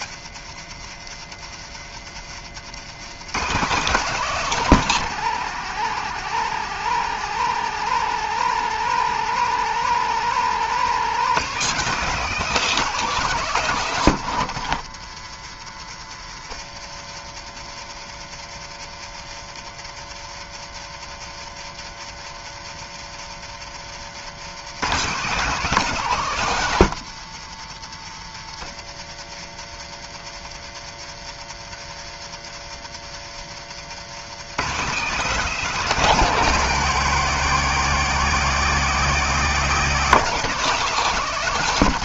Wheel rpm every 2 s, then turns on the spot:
120, 160, 180, 180, 180, 190, 190, 130, 120, 120, 120, 120, 180, 130, 120, 120, 120, 190, 180, 180, 180.
32-34